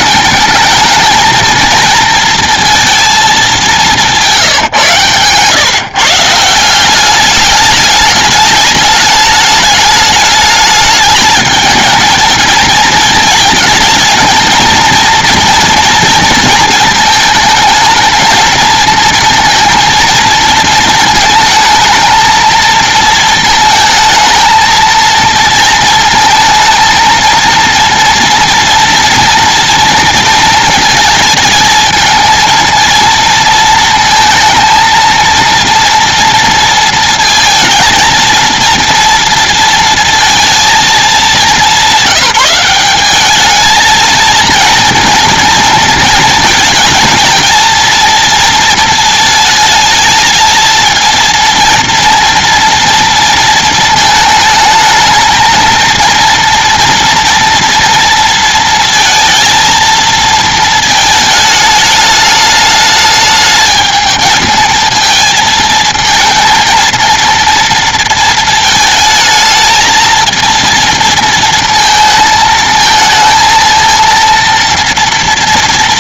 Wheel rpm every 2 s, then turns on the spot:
220, 230, 130, 200, 210, 210, 220, 230, 220, 230, 220, 220, 230, 230, 230, 230, 230, 230, 230, 230, 210, 190, 230, 230, 220, 230, 230, 220, 230, 230, 220, 210, 220, 230, 220, 220, 220, 230.
none